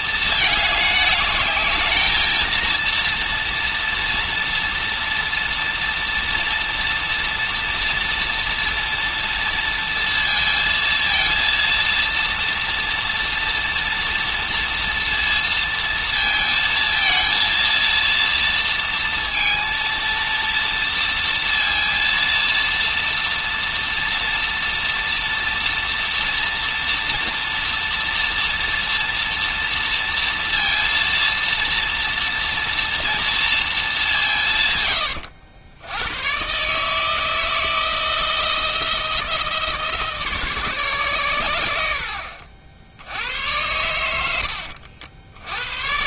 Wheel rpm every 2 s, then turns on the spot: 220, 230, 230, 230, 240, 230, 230, 230, 230, 230, 230, 230, 230, 240, 230, 230, 230, 130, 140, 160, 140, 70, 80.
none